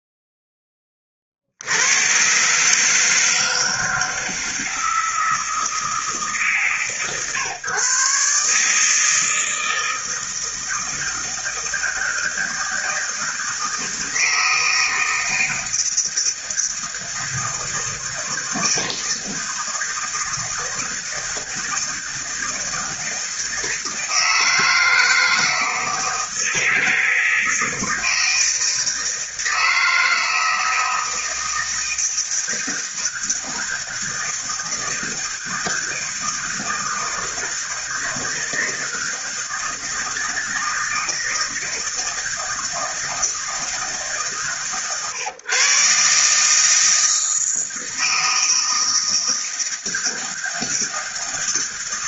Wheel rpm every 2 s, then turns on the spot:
10, 140, 160, 150, 150, 160, 160, 160, 160, 160, 160, 160, 160, 160, 160, 160, 160, 160, 160, 160, 160, 160, 140, 150, 160, 160.
none